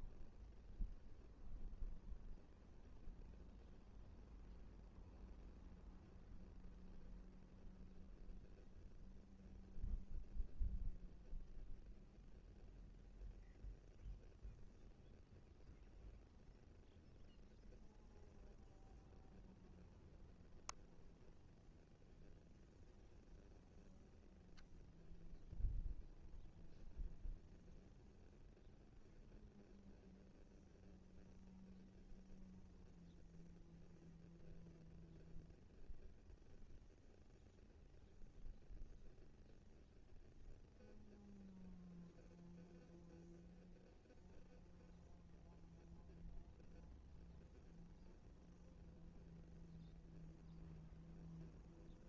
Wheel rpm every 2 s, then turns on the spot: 0, 0, 0, 0, 0, 0, 0, 0, 0, 0, 0, 0, 0, 0, 0, 0, 0, 0, 0, 0, 0, 0, 0, 0, 0, 0.
none